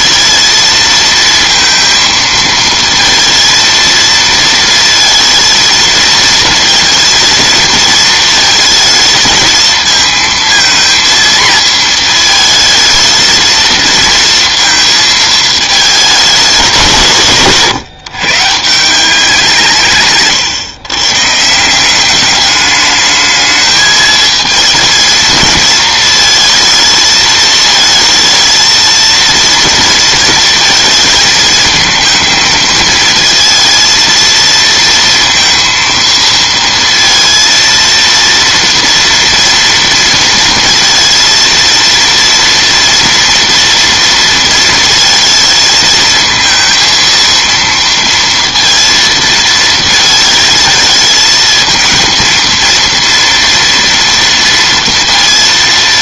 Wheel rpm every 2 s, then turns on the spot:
230, 230, 230, 230, 220, 230, 220, 230, 180, 170, 130, 210, 230, 220, 230, 220, 220, 230, 230, 230, 230, 230, 220, 230, 230, 220, 230, 230.
none